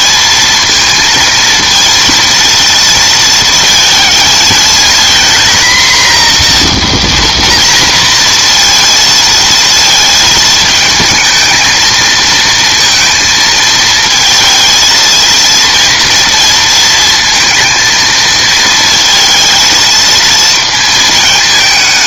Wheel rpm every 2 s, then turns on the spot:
230, 230, 230, 240, 230, 220, 230, 230, 230, 230, 220.
none